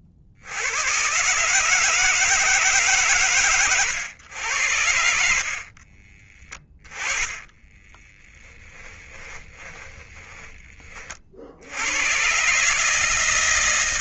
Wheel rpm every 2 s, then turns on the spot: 80, 150, 70, 20, 10, 20, 140.
6-12